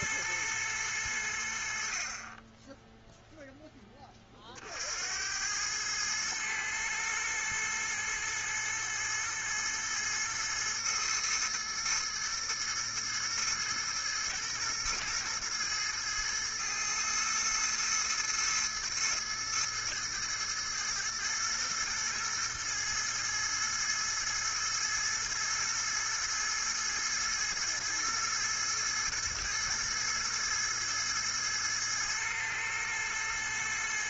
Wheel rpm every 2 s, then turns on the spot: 110, 20, 50, 110, 110, 110, 110, 120, 110, 110, 110, 110, 110, 110, 110, 110, 110.
none